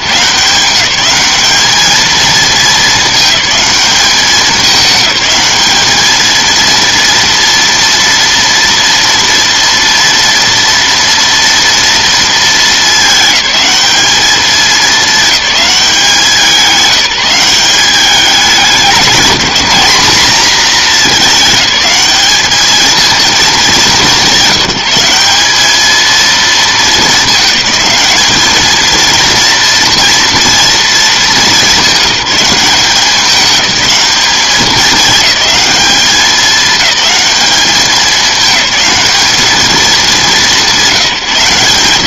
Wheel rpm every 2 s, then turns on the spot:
170, 220, 200, 230, 230, 240, 220, 210, 190, 200, 220, 220, 180, 220, 220, 230, 190, 210, 200, 210, 200.
none